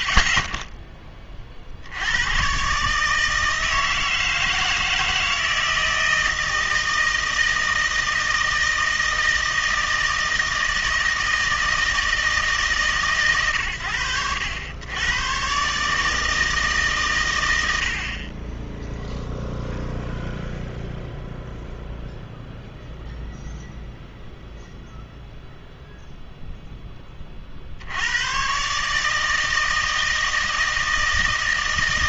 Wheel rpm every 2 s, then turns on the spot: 10, 130, 160, 160, 160, 160, 150, 80, 150, 20, 0, 0, 0, 0, 130, 160.
none